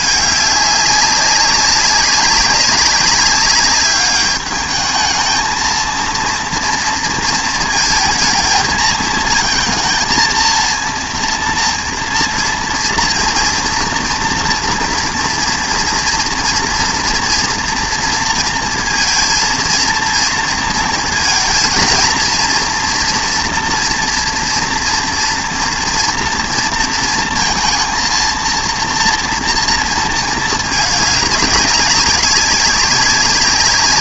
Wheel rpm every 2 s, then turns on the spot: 200, 190, 220, 230, 220, 230, 230, 230, 230, 230, 230, 230, 230, 230, 230, 210, 190.
none